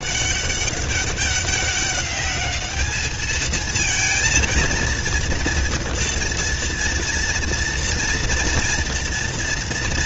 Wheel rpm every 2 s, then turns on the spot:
200, 220, 230, 230, 230.
none